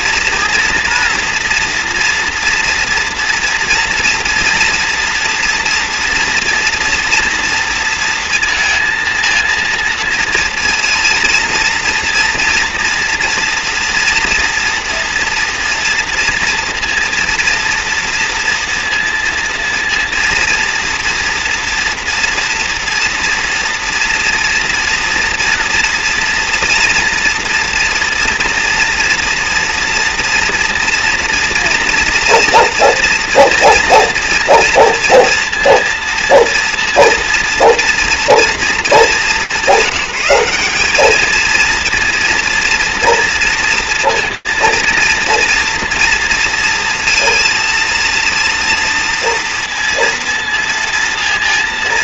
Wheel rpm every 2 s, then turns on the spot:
230, 230, 230, 230, 230, 230, 240, 230, 230, 230, 230, 230, 240, 240, 230, 230, 240, 230, 230, 210, 190, 230, 230, 230, 230, 230.
none